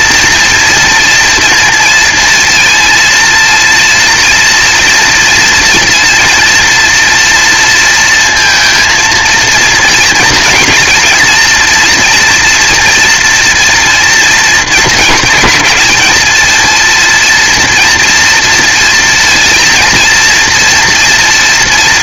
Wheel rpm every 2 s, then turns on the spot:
240, 220, 230, 230, 230, 220, 230, 210, 230, 230, 240.
none